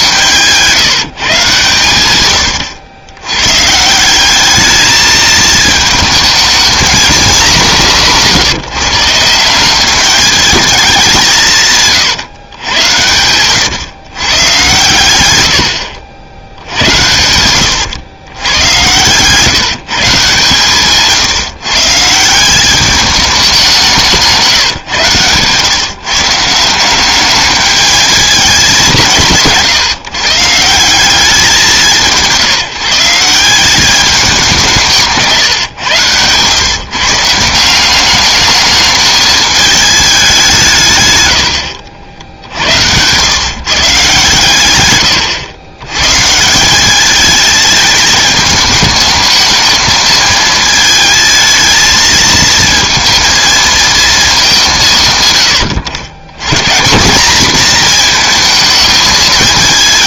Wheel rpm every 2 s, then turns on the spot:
160, 100, 210, 230, 150, 200, 110, 120, 80, 110, 140, 200, 140, 170, 200, 170, 170, 180, 130, 210, 180, 100, 120, 170, 210, 220, 220, 180, 150, 220.
2-4 24-26